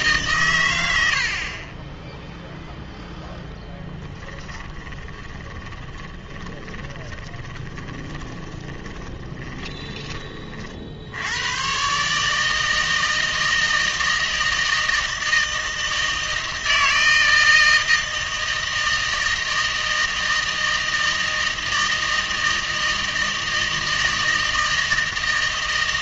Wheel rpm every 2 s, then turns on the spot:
90, 0, 20, 30, 40, 50, 160, 160, 160, 160, 160, 160, 160.
4-10